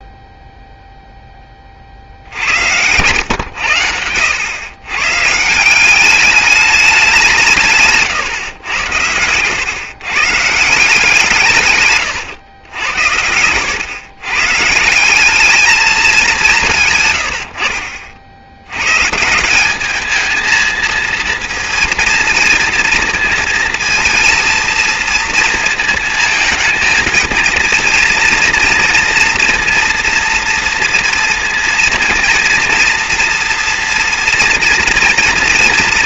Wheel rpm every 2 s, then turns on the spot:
0, 70, 100, 200, 130, 130, 110, 130, 190, 60, 220, 230, 230, 230, 230, 230, 230, 230.
8-10